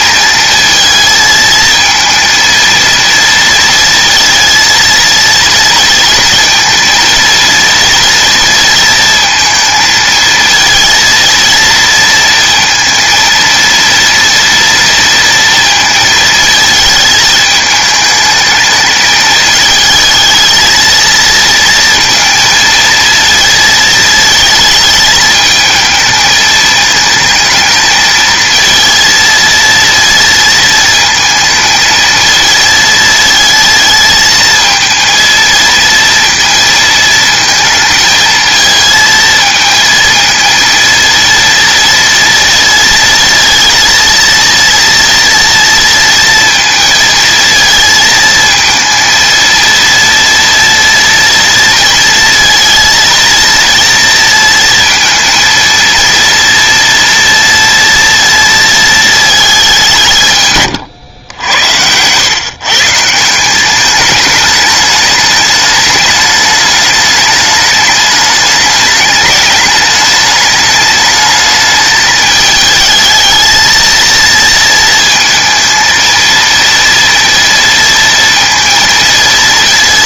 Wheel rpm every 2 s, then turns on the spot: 220, 230, 230, 230, 230, 230, 230, 230, 220, 220, 220, 230, 220, 220, 220, 220, 220, 230, 230, 220, 230, 230, 230, 230, 230, 230, 230, 230, 230, 230, 120, 150, 210, 210, 210, 210, 220, 230, 230, 230.
60-62